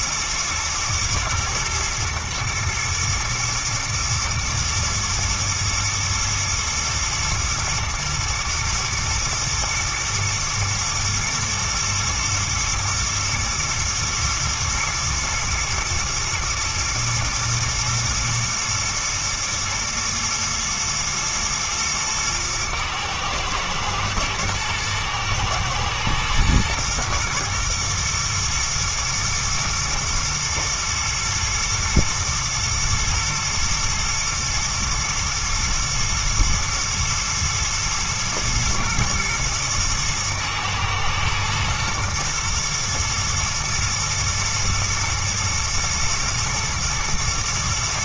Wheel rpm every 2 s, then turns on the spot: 110, 110, 110, 120, 110, 120, 110, 110, 110, 110, 120, 110, 120, 120, 110, 110, 120, 110, 110, 110, 110, 120, 110, 110.
none